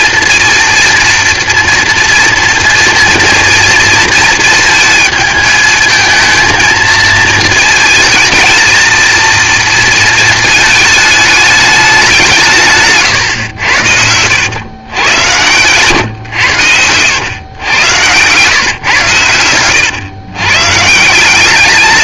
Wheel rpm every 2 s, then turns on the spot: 230, 230, 230, 230, 220, 220, 150, 110, 100, 120, 130.
none